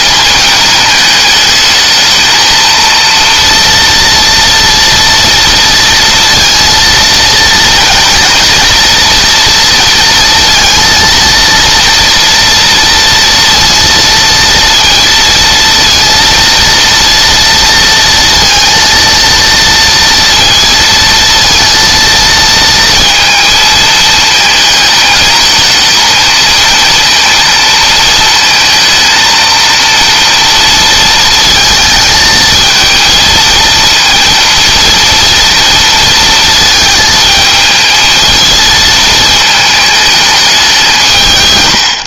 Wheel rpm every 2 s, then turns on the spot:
210, 230, 230, 230, 230, 230, 230, 230, 230, 230, 230, 230, 220, 230, 230, 230, 220, 230, 220, 220, 170.
none